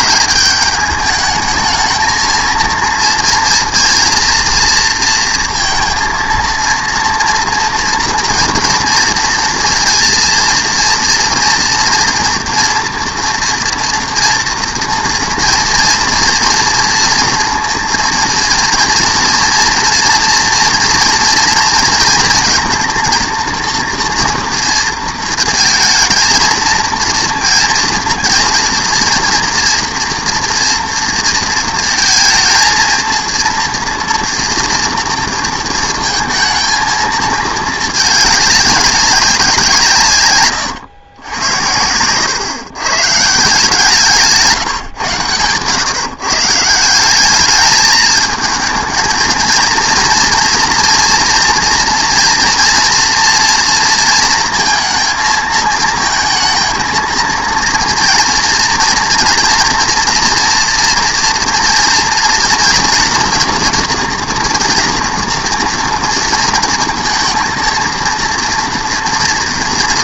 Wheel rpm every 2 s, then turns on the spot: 210, 230, 230, 230, 230, 230, 230, 230, 230, 230, 230, 230, 230, 230, 230, 230, 220, 230, 230, 200, 120, 120, 150, 160, 220, 230, 230, 230, 230, 230, 230, 240, 230, 230, 230.
none